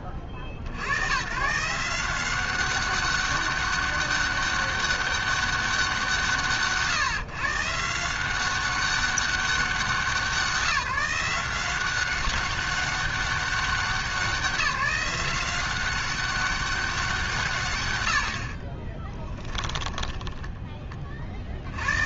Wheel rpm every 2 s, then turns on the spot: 50, 200, 200, 120, 190, 170, 190, 180, 190, 60, 20.
none